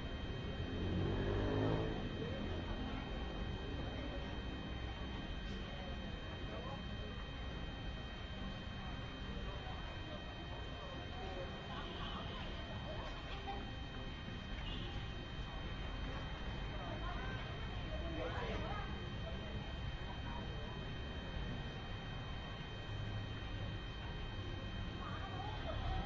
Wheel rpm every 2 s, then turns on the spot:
0, 0, 0, 0, 0, 0, 0, 0, 0, 0, 0, 0, 0.
none